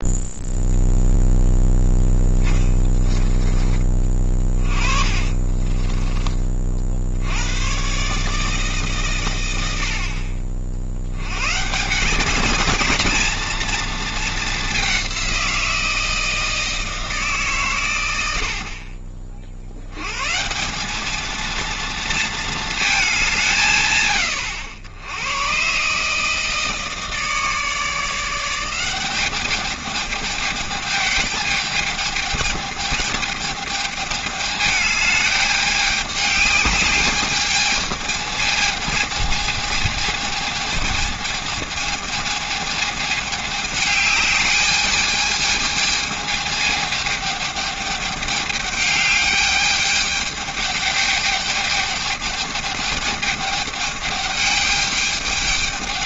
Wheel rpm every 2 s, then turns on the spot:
0, 10, 30, 20, 150, 50, 190, 220, 160, 90, 130, 230, 110, 150, 160, 210, 210, 210, 200, 220, 220, 220, 210, 220, 210, 210, 210, 210.
2-6